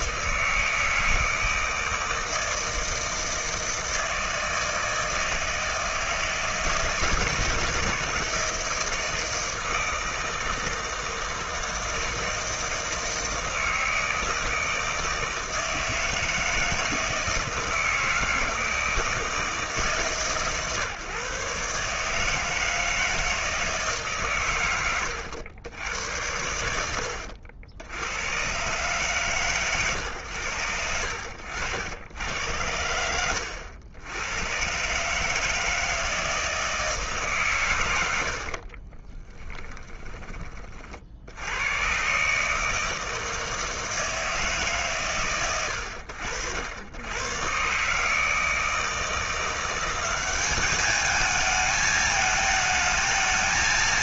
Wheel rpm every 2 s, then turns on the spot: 160, 160, 160, 160, 160, 160, 160, 160, 160, 160, 140, 160, 130, 90, 120, 80, 80, 130, 160, 50, 30, 150, 160, 80, 160, 200, 220.
38-40